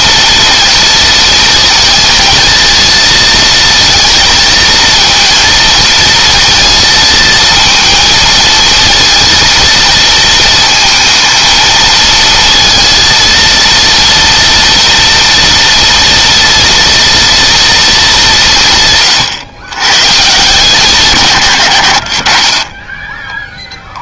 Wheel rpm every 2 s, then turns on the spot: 230, 230, 230, 230, 230, 220, 230, 230, 230, 150, 170, 20.
none